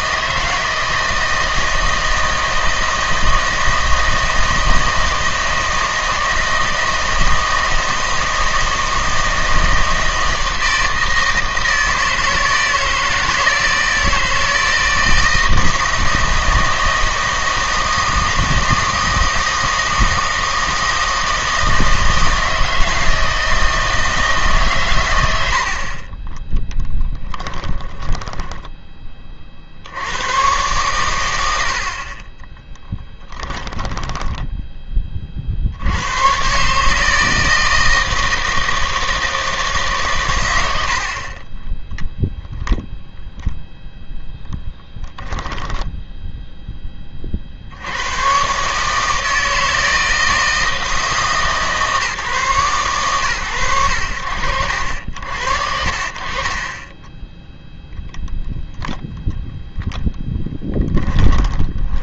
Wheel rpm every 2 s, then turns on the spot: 160, 160, 160, 160, 160, 160, 160, 160, 160, 160, 160, 160, 140, 10, 10, 120, 20, 20, 140, 160, 90, 0, 0, 10, 130, 160, 130, 60, 30, 0, 10.
26-28 32-34 56-58 60-62